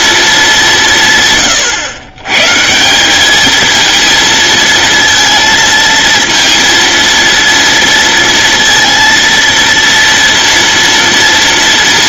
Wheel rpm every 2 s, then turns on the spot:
180, 160, 230, 230, 230, 230.
none